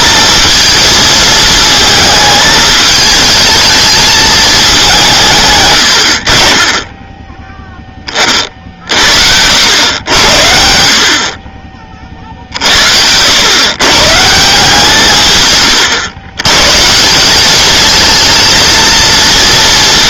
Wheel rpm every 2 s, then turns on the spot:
230, 220, 190, 20, 50, 70, 70, 160, 140, 220.
none